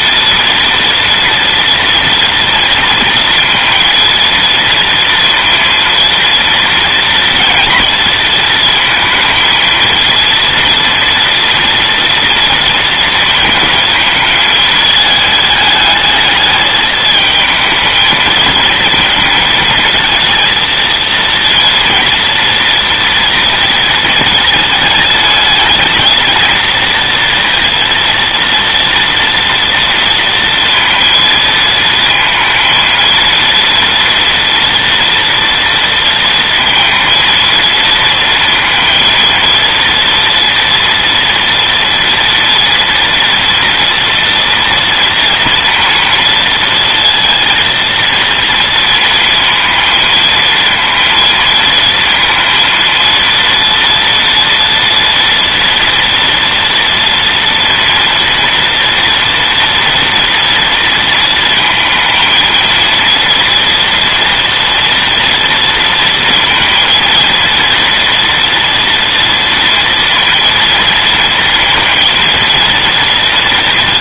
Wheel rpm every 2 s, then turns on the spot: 230, 230, 230, 230, 230, 230, 230, 220, 220, 220, 230, 230, 210, 230, 230, 230, 230, 230, 230, 230, 230, 230, 230, 230, 230, 230, 230, 230, 230, 240, 230, 230, 230, 230, 230, 230, 230.
none